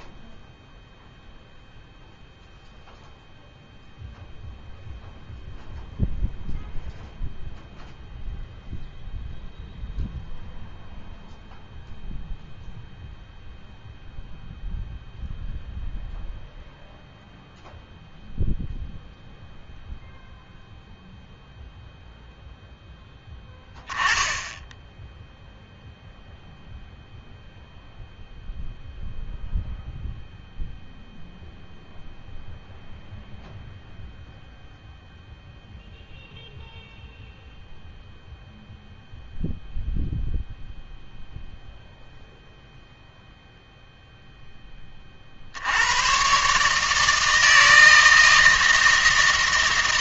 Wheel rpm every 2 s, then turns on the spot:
0, 0, 0, 0, 0, 0, 0, 0, 0, 0, 0, 0, 10, 0, 0, 0, 0, 0, 0, 0, 0, 0, 10, 150, 160.
none